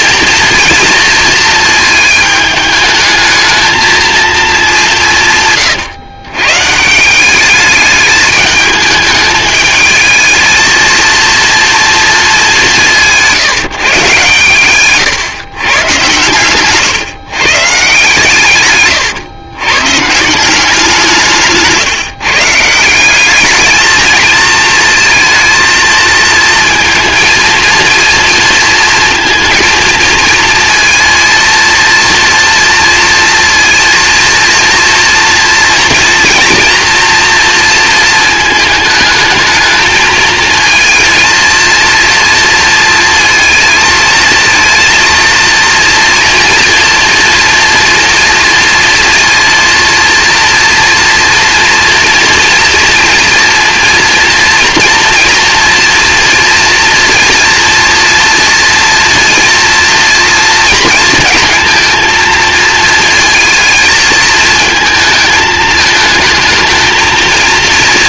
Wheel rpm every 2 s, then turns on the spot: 230, 220, 220, 150, 220, 220, 200, 130, 130, 130, 170, 160, 220, 230, 230, 230, 230, 230, 240, 220, 220, 230, 230, 240, 230, 230, 240, 240, 230, 230, 230, 220, 220, 220.
none